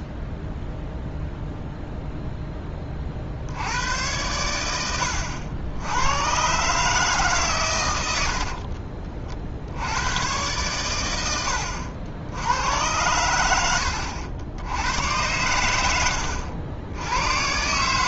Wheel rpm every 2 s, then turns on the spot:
0, 10, 100, 140, 50, 110, 90, 90, 80.
8-10